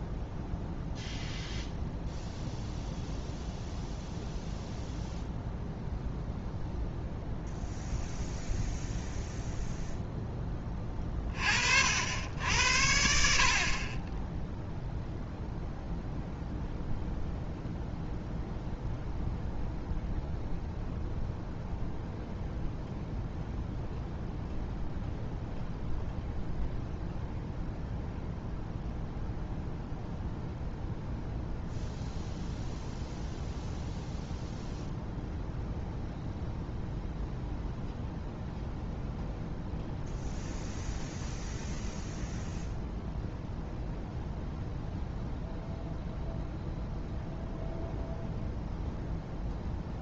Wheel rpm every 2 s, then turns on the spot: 0, 0, 0, 0, 0, 20, 70, 0, 0, 0, 0, 0, 0, 0, 0, 0, 0, 0, 0, 0, 0, 0, 0, 0, 0.
none